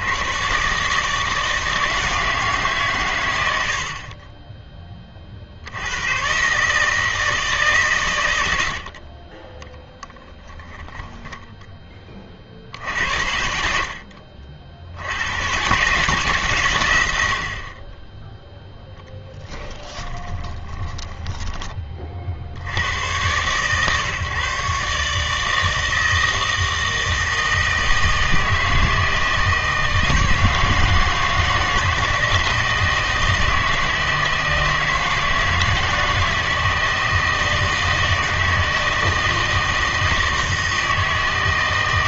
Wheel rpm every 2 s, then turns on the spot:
130, 140, 10, 150, 80, 20, 60, 70, 120, 0, 30, 90, 140, 160, 160, 160, 160, 160, 160, 160, 160.
10-12 20-22